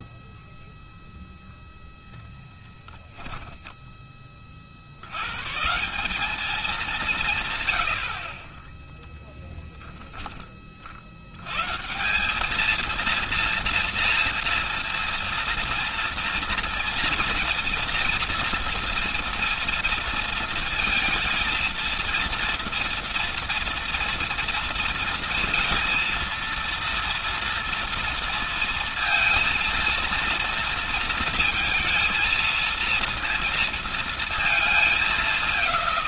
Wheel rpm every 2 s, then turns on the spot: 0, 0, 50, 200, 30, 30, 210, 230, 230, 230, 230, 230, 230, 240, 230, 230, 230, 220.
8-10